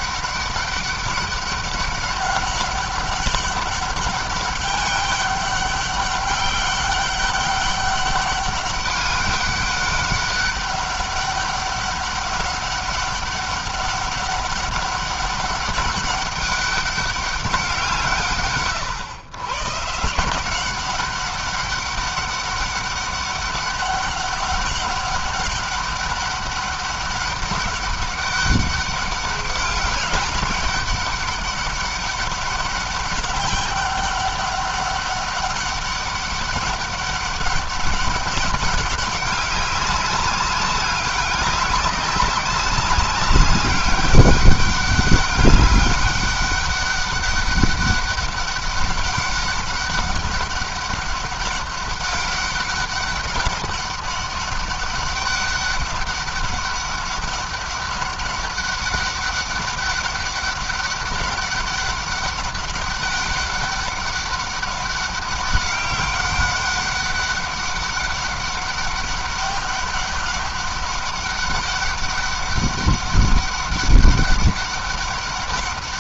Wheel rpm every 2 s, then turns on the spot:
200, 190, 200, 200, 200, 200, 200, 200, 200, 120, 180, 200, 200, 200, 200, 200, 200, 200, 200, 200, 200, 190, 200, 200, 200, 200, 200, 200, 200, 200, 200, 200, 200, 200, 200, 200, 200, 200.
none